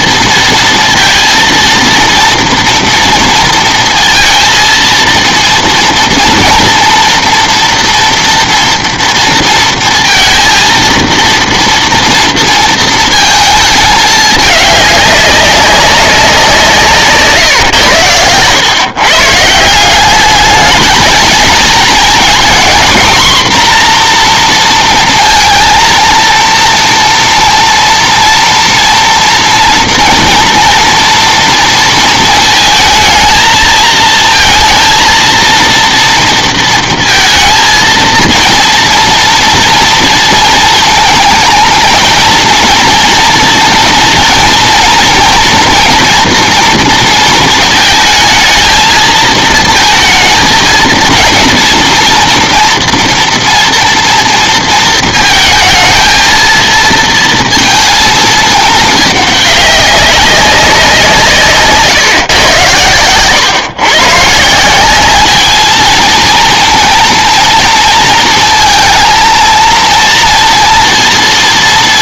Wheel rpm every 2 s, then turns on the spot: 220, 230, 230, 230, 230, 230, 230, 210, 180, 120, 210, 240, 240, 230, 230, 230, 220, 230, 230, 230, 220, 230, 230, 230, 220, 220, 230, 230, 230, 220, 190, 120, 180, 230, 230, 230.
none